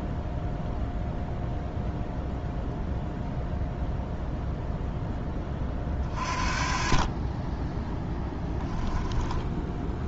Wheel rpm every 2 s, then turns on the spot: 0, 0, 0, 40, 10.
8-10